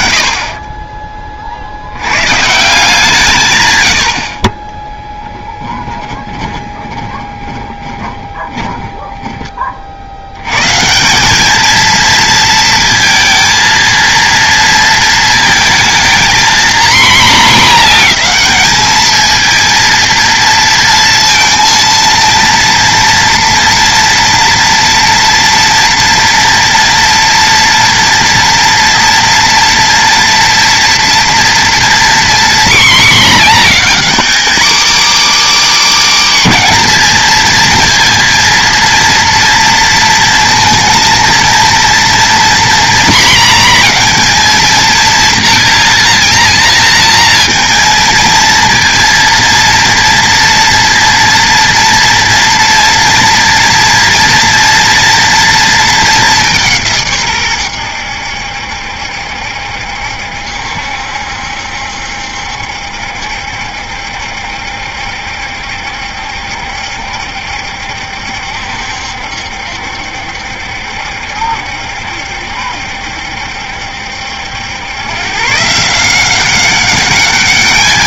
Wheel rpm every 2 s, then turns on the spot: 30, 160, 30, 20, 10, 140, 230, 230, 240, 220, 230, 230, 230, 230, 230, 230, 240, 270, 260, 230, 230, 240, 230, 240, 230, 230, 230, 240, 170, 70, 70, 70, 70, 70, 70, 70, 70, 100, 190.
6-10